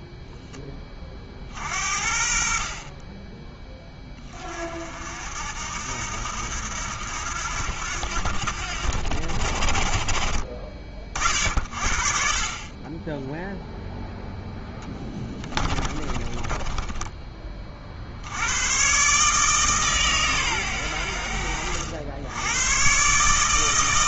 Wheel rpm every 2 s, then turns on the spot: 20, 40, 60, 80, 60, 40, 20, 10, 20, 120, 100, 120.
14-18